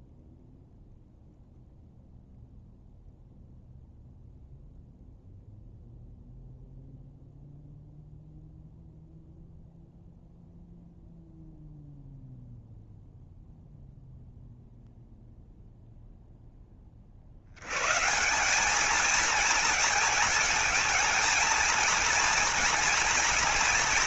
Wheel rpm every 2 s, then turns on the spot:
0, 0, 0, 0, 0, 0, 0, 0, 20, 200, 220, 230.
none